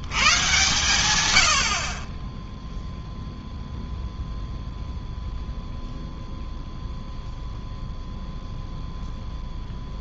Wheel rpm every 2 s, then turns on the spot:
140, 0, 0, 0, 0.
none